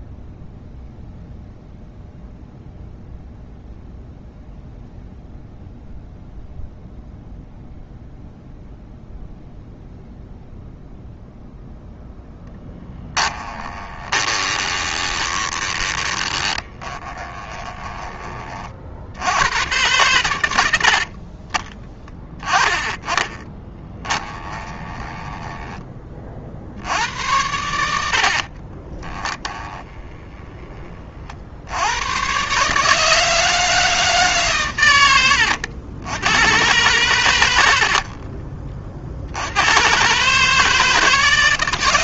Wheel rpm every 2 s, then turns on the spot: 0, 0, 0, 0, 0, 0, 10, 20, 20, 60, 60, 10, 20, 80, 20, 30, 150, 100, 110, 50, 160.
12-18 24-26 28-30